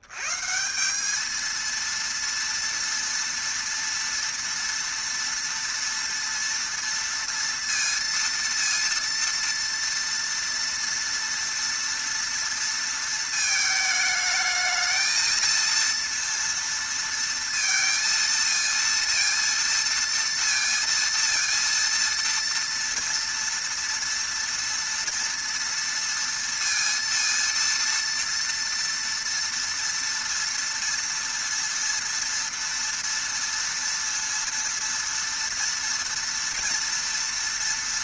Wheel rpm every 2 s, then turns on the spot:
90, 230, 230, 230, 230, 230, 230, 220, 230, 230, 230, 230, 230, 230, 230, 230, 230, 230, 230.
none